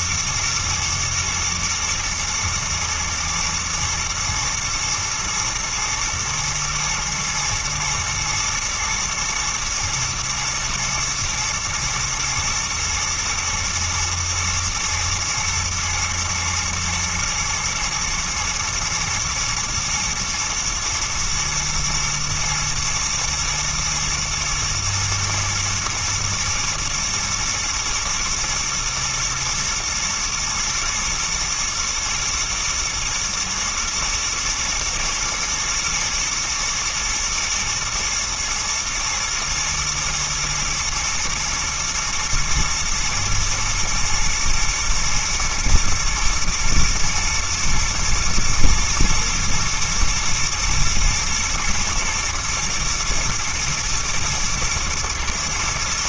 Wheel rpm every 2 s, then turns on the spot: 120, 120, 120, 110, 120, 110, 120, 110, 110, 110, 120, 120, 110, 110, 120, 120, 110, 110, 110, 120, 110, 120, 110, 110, 110, 120, 110, 110.
none